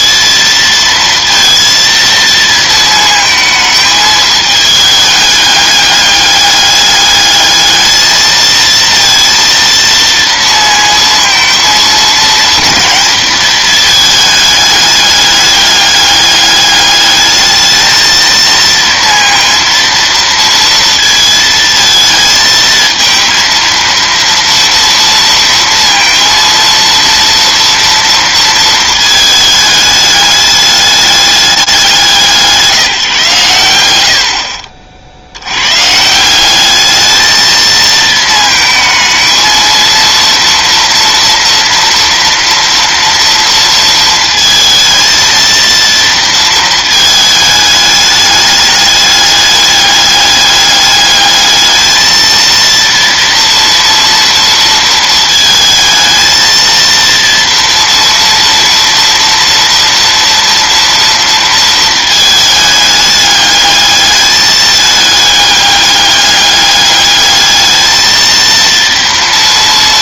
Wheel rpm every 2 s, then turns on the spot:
230, 230, 210, 210, 230, 230, 230, 210, 210, 230, 230, 220, 230, 230, 220, 210, 160, 50, 200, 220, 230, 230, 220, 230, 210, 210, 230, 230, 230, 230, 230, 220, 210, 200, 230.
none